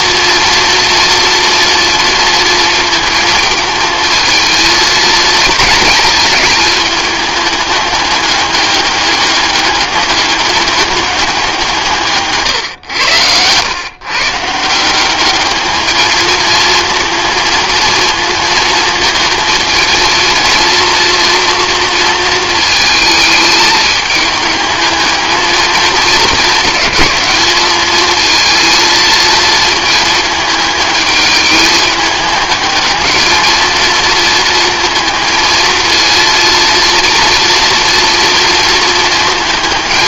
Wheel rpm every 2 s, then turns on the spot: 230, 230, 220, 220, 210, 200, 150, 140, 220, 220, 230, 230, 220, 210, 220, 220, 210, 230, 230, 230.
none